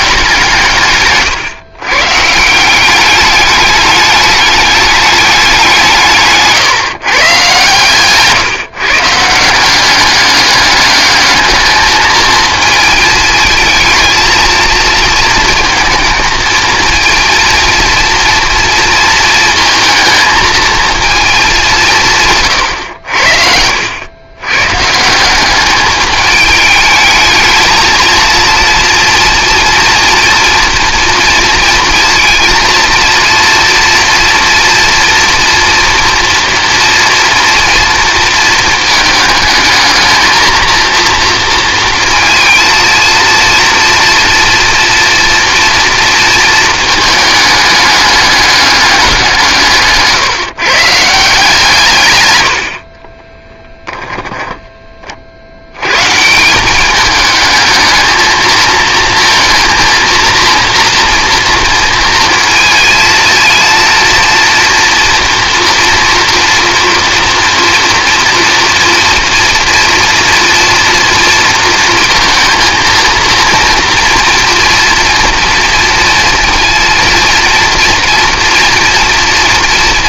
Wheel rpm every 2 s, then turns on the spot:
130, 200, 200, 140, 150, 210, 220, 230, 230, 230, 230, 90, 160, 210, 230, 230, 230, 240, 240, 220, 230, 230, 230, 220, 200, 150, 40, 20, 200, 220, 230, 230, 230, 230, 230, 230, 230, 230, 230, 230.
52-54